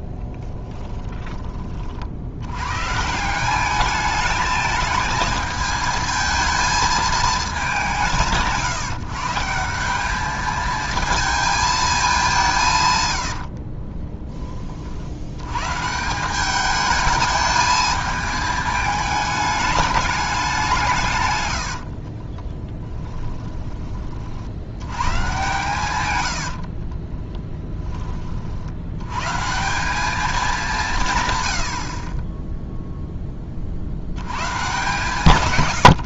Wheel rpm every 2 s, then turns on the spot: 10, 110, 220, 220, 160, 220, 160, 30, 200, 220, 190, 20, 90, 60, 70, 200, 0, 120.
0-2 22-24 26-28